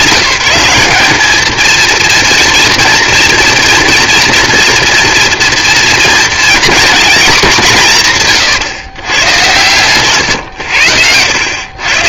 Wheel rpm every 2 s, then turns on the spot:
180, 230, 240, 240, 130, 100.
none